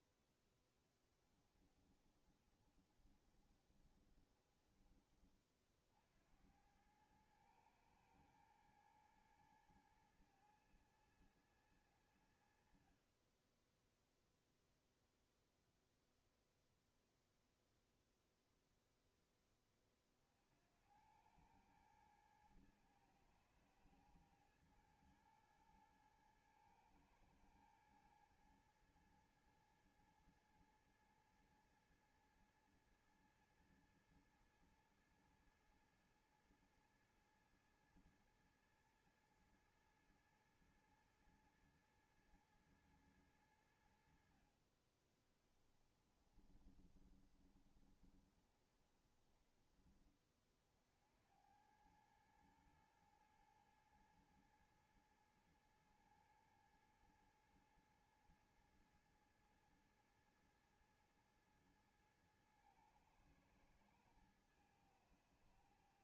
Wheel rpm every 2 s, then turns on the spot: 0, 20, 40, 40, 110, 110, 100, 10, 0, 0, 30, 100, 110, 110, 110, 110, 110, 110, 110, 110, 110, 110, 90, 20, 20, 20, 90, 110, 110, 110, 110, 110, 110.
2-6 46-50